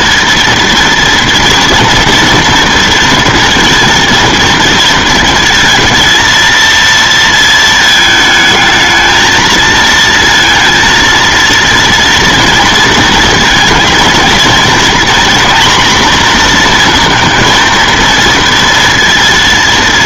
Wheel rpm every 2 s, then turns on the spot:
230, 230, 230, 220, 220, 230, 230, 230, 240, 230.
none